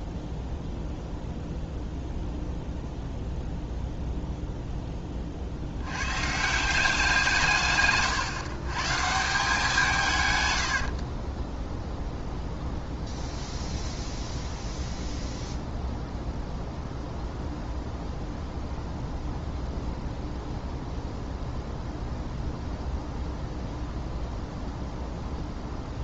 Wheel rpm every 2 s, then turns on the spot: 0, 0, 10, 180, 130, 90, 0, 0, 0, 0, 0, 0, 0.
none